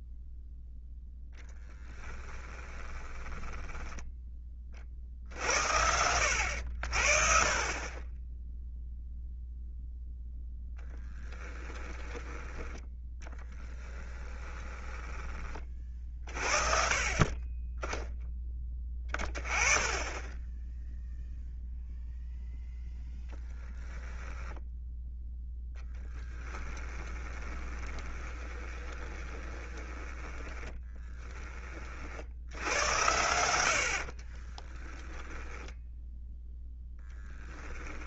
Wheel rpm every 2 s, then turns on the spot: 0, 20, 50, 60, 0, 10, 10, 20, 40, 20, 0, 10, 0, 20, 20, 30, 90, 10, 10.
2-4 10-12 14-16 26-32 34-36